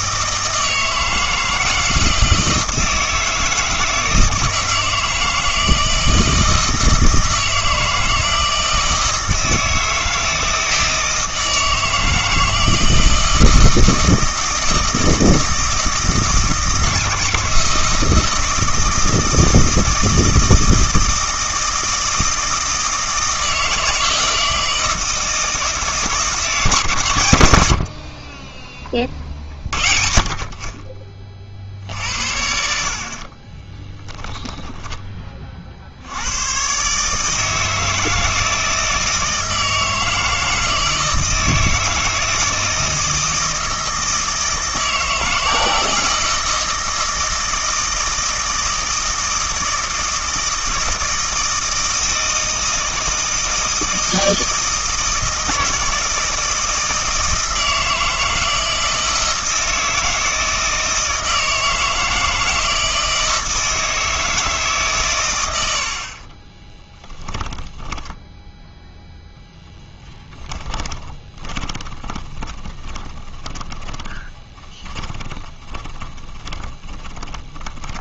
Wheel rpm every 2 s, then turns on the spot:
160, 160, 160, 160, 160, 160, 160, 160, 160, 160, 160, 160, 160, 150, 30, 40, 60, 10, 120, 160, 160, 160, 160, 160, 160, 160, 160, 160, 160, 160, 160, 160, 150, 20, 0, 10, 20, 20, 20.
34-36 66-68 70-78